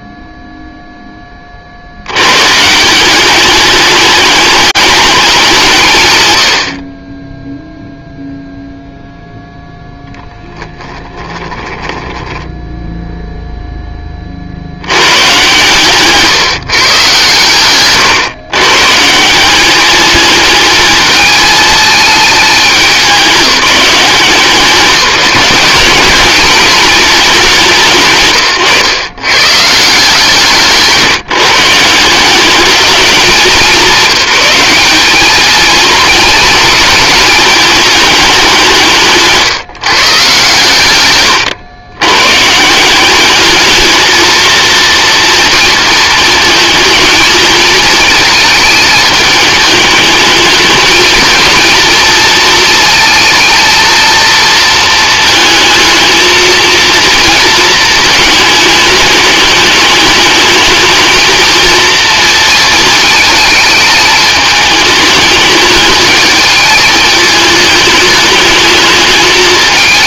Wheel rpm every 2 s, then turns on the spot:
30, 200, 200, 10, 0, 10, 0, 130, 120, 190, 220, 190, 190, 180, 150, 160, 180, 220, 220, 160, 110, 220, 230, 220, 220, 220, 220, 220, 230, 210, 230, 220, 210, 220, 190.
10-12